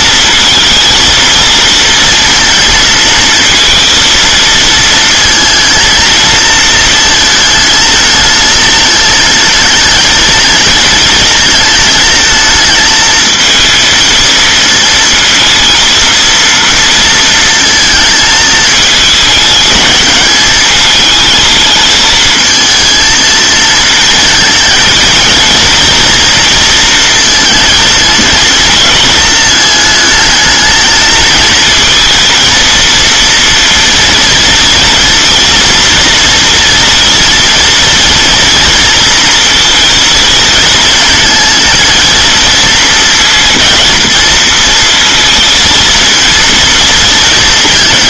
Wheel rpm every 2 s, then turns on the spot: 230, 230, 220, 230, 220, 230, 220, 230, 230, 220, 220, 230, 230, 230, 230, 220, 230, 240, 230, 230, 220, 230, 220, 230.
none